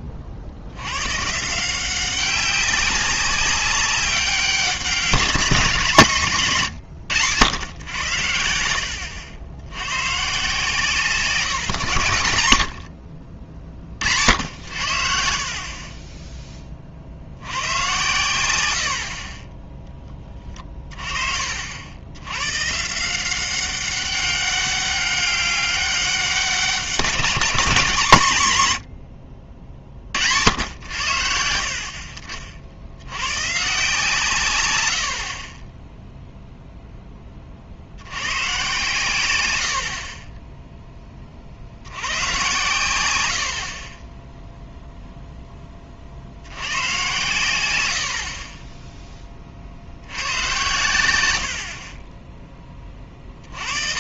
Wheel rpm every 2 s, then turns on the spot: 90, 190, 190, 140, 80, 160, 90, 70, 30, 80, 30, 140, 200, 190, 100, 90, 60, 110, 0, 130, 10, 110, 0, 100, 20, 100, 20.
none